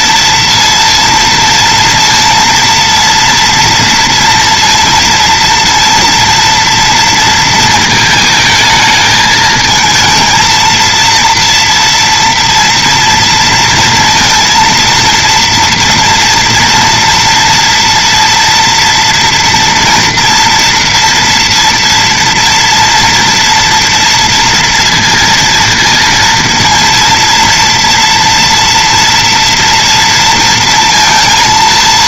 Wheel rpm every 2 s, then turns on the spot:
230, 230, 230, 230, 220, 230, 230, 230, 230, 240, 230, 230, 230, 230, 240, 230.
none